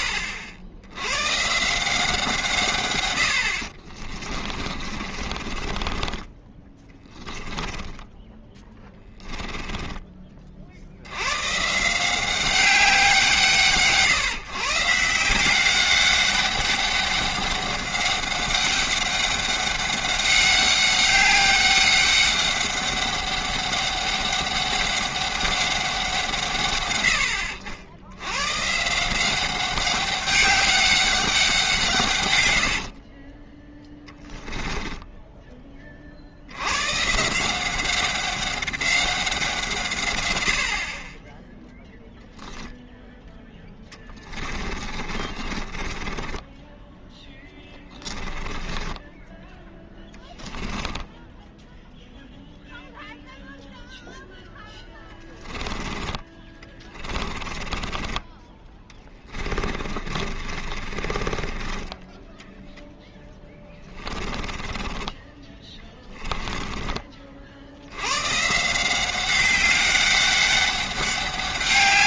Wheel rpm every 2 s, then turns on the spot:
90, 110, 40, 20, 10, 80, 180, 150, 200, 200, 200, 200, 200, 110, 160, 200, 50, 10, 130, 190, 40, 0, 40, 10, 20, 10, 0, 10, 20, 20, 30, 10, 20, 30, 180, 200.
4-10 32-36 44-52 54-66